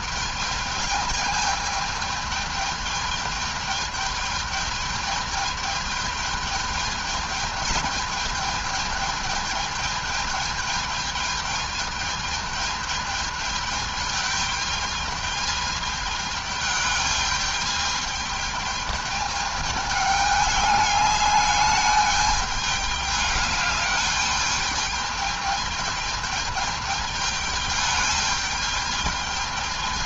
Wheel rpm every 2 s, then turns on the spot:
210, 210, 210, 210, 210, 210, 210, 210, 210, 210, 210, 210, 210, 210, 210.
none